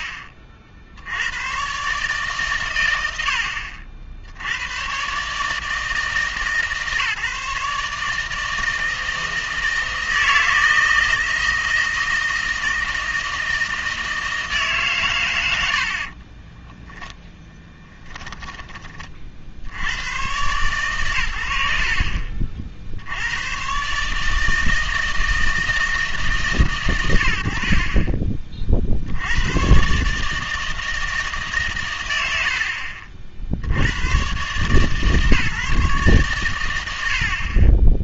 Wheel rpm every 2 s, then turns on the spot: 60, 120, 100, 150, 160, 160, 160, 160, 10, 10, 120, 50, 160, 140, 40, 160, 70, 140, 90.
16-18